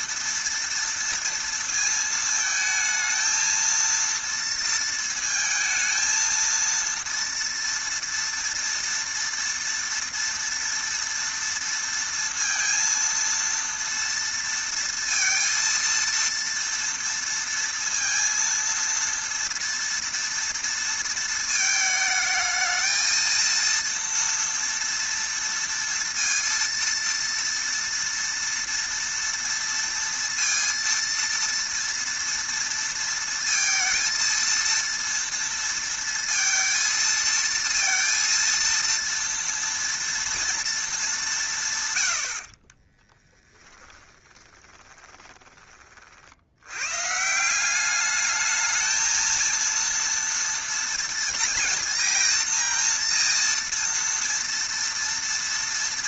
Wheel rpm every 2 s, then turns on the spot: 230, 220, 230, 230, 230, 230, 230, 230, 230, 230, 230, 220, 230, 230, 230, 230, 230, 230, 230, 230, 230, 40, 10, 90, 220, 230, 230, 230.
42-46